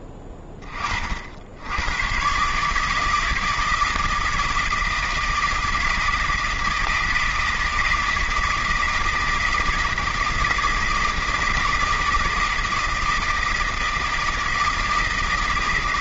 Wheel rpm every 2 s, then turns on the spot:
40, 150, 160, 160, 160, 160, 160, 160.
none